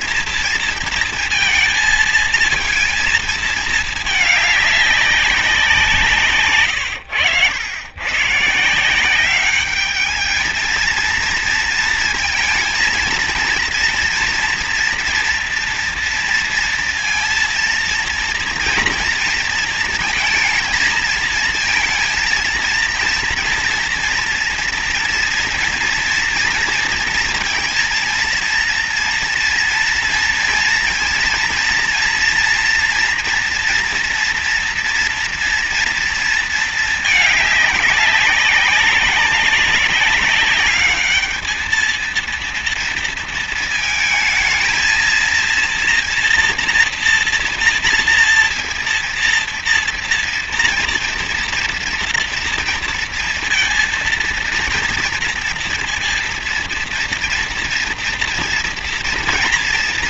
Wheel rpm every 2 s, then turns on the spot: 230, 230, 210, 120, 170, 220, 230, 230, 230, 240, 230, 230, 230, 230, 230, 230, 240, 240, 220, 190, 200, 230, 220, 230, 230, 230, 230, 240, 230, 230.
6-8